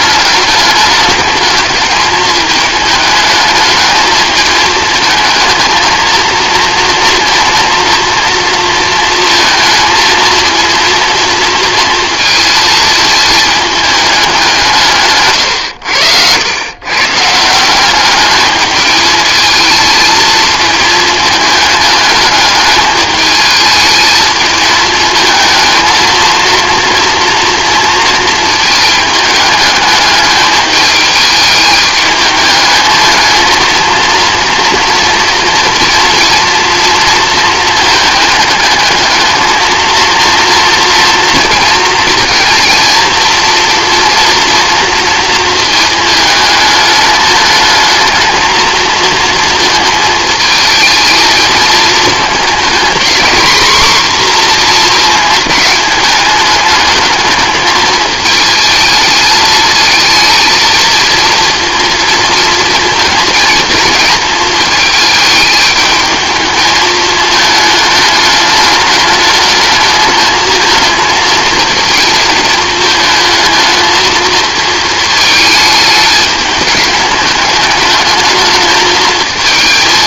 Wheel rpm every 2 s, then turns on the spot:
210, 210, 220, 230, 230, 230, 220, 170, 120, 210, 220, 210, 220, 230, 220, 210, 220, 230, 230, 220, 230, 230, 230, 210, 220, 220, 230, 240, 210, 220, 230, 230, 220, 220, 210, 220, 220, 220, 210, 220.
none